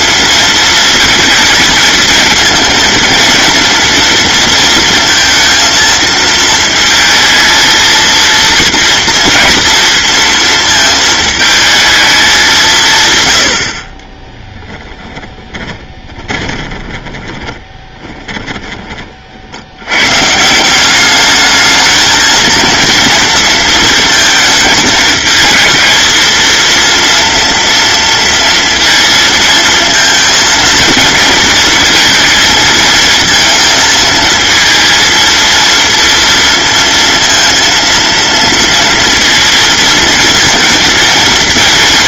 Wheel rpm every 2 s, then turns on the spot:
230, 230, 230, 220, 230, 230, 170, 10, 20, 20, 180, 230, 220, 230, 230, 230, 220, 220, 230, 230, 230.
14-18